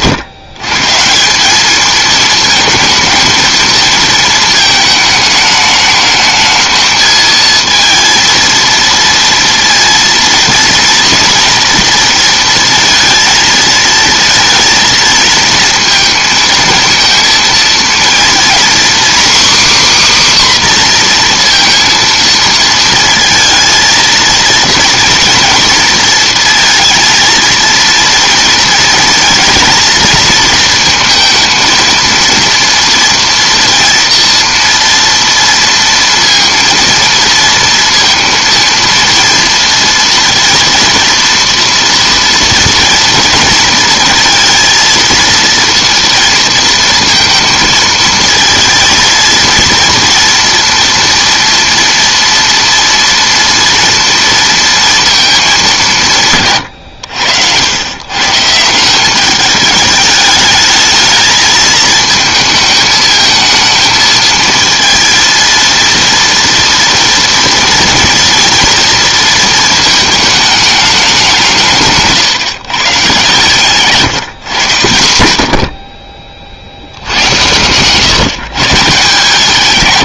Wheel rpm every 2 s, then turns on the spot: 130, 220, 220, 220, 230, 230, 230, 230, 230, 250, 270, 230, 230, 230, 230, 230, 230, 230, 230, 230, 230, 230, 230, 230, 230, 230, 230, 230, 130, 150, 210, 220, 230, 230, 230, 220, 130, 130, 60, 140.
none